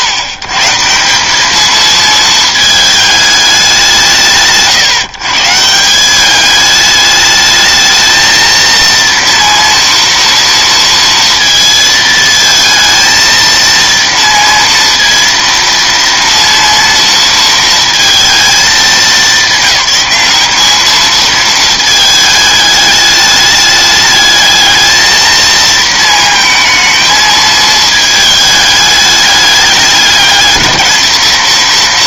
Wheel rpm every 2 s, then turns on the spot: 130, 220, 120, 210, 230, 230, 220, 230, 230, 220, 210, 210, 220, 220, 210, 210.
none